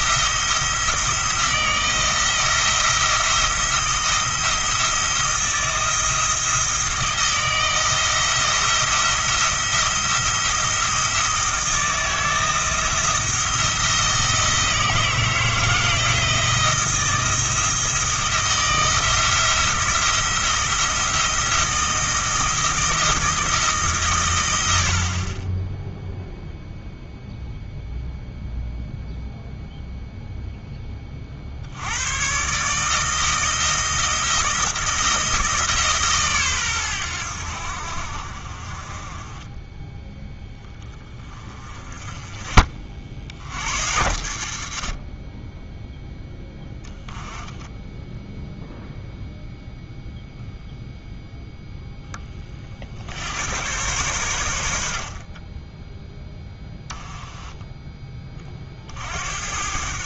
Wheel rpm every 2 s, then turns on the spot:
160, 170, 160, 160, 170, 170, 170, 160, 170, 170, 170, 170, 70, 0, 0, 10, 150, 160, 110, 40, 10, 40, 50, 10, 0, 0, 50, 80, 10, 50.
none